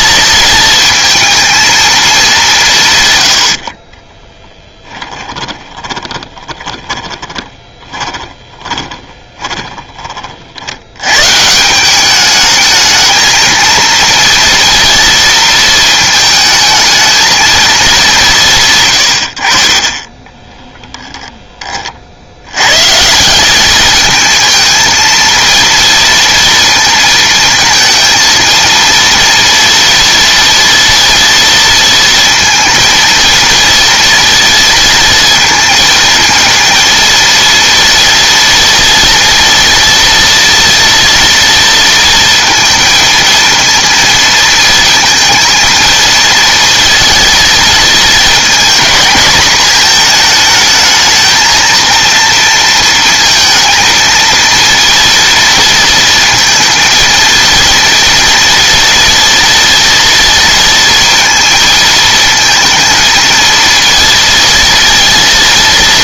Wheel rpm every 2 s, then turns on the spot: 230, 170, 10, 20, 20, 70, 210, 230, 220, 140, 20, 110, 220, 230, 230, 230, 230, 230, 230, 230, 230, 230, 220, 230, 230, 220, 230, 230, 230, 230, 230, 220, 230.
4-10 20-22